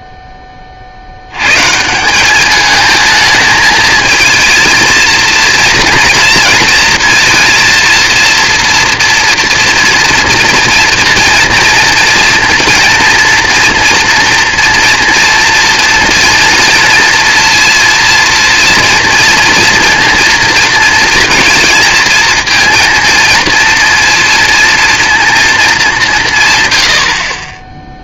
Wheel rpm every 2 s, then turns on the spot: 30, 200, 230, 230, 240, 230, 230, 230, 230, 230, 230, 230, 230, 200.
none